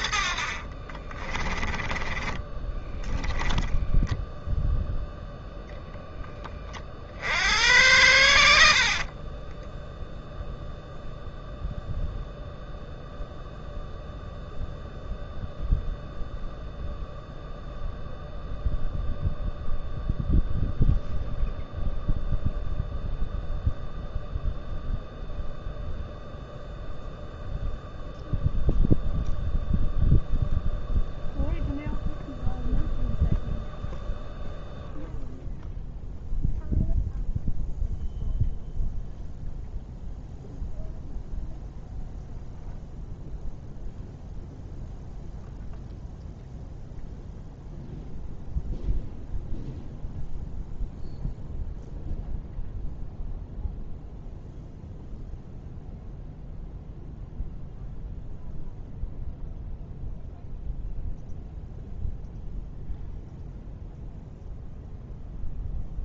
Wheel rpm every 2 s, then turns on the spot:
50, 10, 0, 30, 60, 0, 0, 0, 0, 0, 0, 0, 0, 0, 0, 0, 0, 0, 0, 0, 0, 0, 0, 0, 0, 0, 0, 0, 0, 0, 0, 0, 0.
0-4